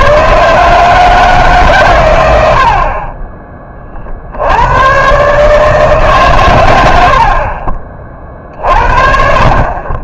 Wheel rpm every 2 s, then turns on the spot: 160, 50, 110, 90, 50.
none